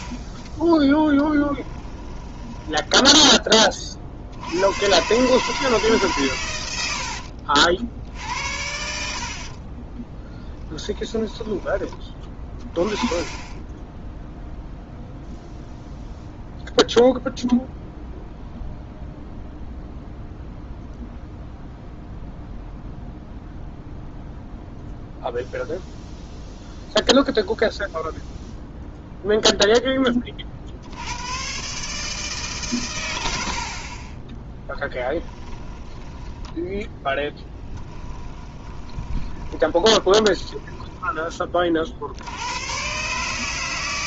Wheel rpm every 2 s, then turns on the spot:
10, 10, 100, 100, 70, 10, 20, 0, 0, 0, 0, 0, 0, 0, 0, 60, 140, 10, 10, 10, 10, 100.
0-4 10-12 34-36 38-42